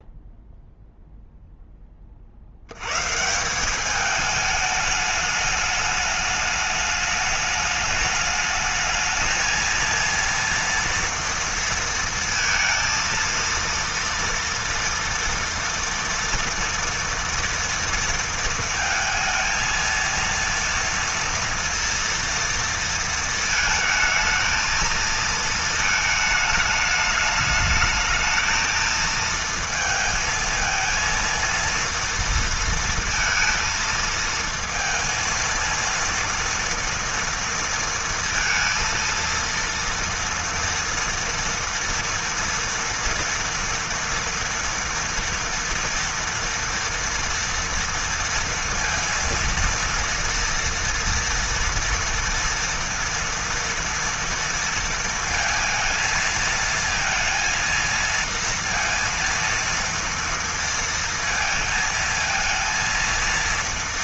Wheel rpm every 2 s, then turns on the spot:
0, 140, 210, 210, 220, 230, 230, 230, 230, 220, 230, 230, 220, 210, 230, 230, 230, 230, 230, 230, 230, 230, 230, 230, 230, 230, 230, 230, 230, 230, 230, 230.
none